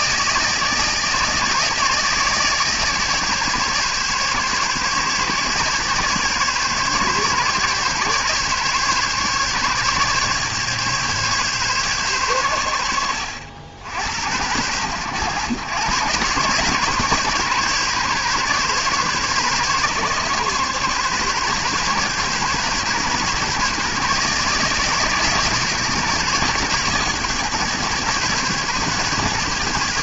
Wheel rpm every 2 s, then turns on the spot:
160, 150, 140, 140, 140, 140, 80, 100, 140, 130, 140, 130, 150, 140, 140.
none